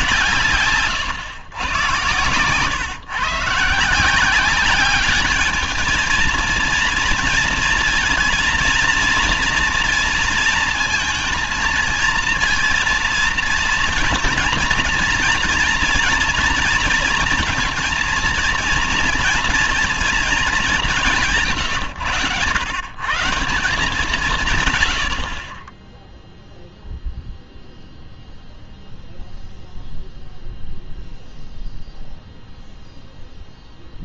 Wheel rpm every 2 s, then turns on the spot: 150, 130, 190, 230, 230, 230, 230, 230, 230, 230, 200, 120, 150, 0, 0, 0, 0.
none